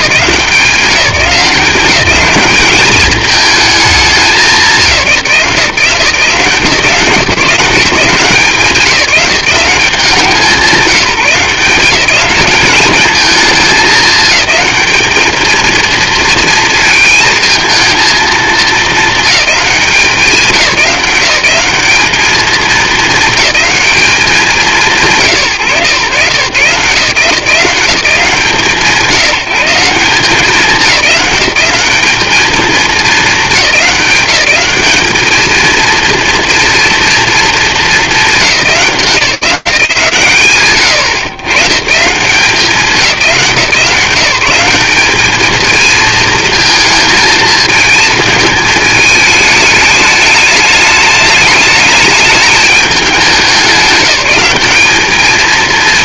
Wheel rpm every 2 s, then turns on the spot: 190, 210, 180, 170, 190, 180, 210, 210, 230, 220, 190, 220, 170, 140, 170, 190, 220, 190, 230, 200, 120, 190, 190, 220, 220, 210, 210, 210.
none